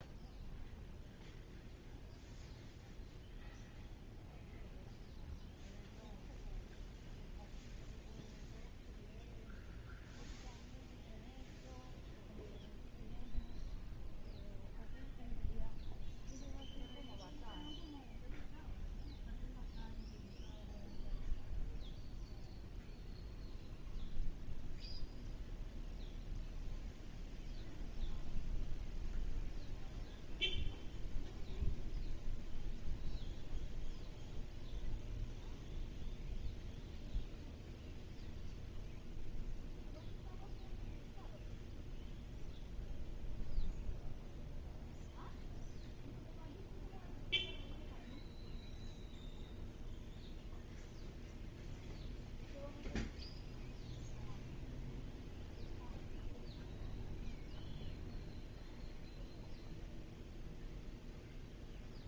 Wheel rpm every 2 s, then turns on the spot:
0, 0, 0, 0, 0, 0, 0, 0, 0, 0, 0, 0, 0, 0, 0, 0, 0, 0, 0, 0, 0, 0, 0, 0, 0, 0, 0, 0, 0, 0, 0.
none